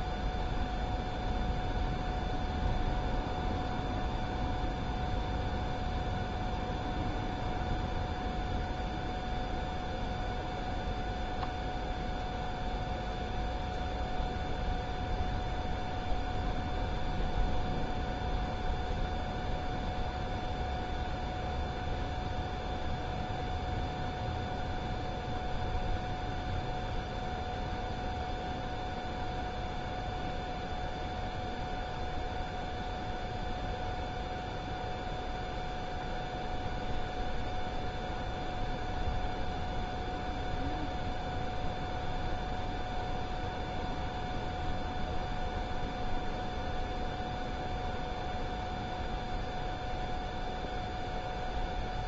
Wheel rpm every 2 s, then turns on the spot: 0, 0, 0, 0, 0, 0, 0, 0, 0, 0, 0, 0, 0, 0, 0, 0, 0, 0, 0, 0, 0, 0, 0, 0, 0, 0.
none